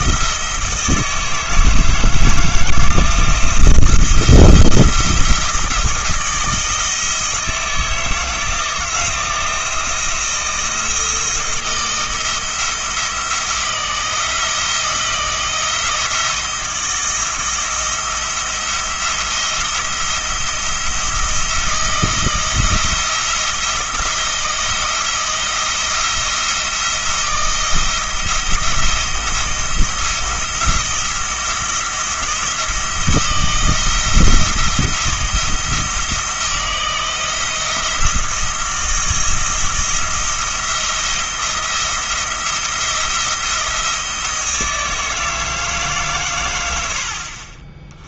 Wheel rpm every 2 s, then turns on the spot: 160, 160, 170, 160, 170, 170, 160, 160, 160, 170, 170, 170, 170, 170, 170, 170, 160, 170, 170, 170, 170, 170, 160, 90.
none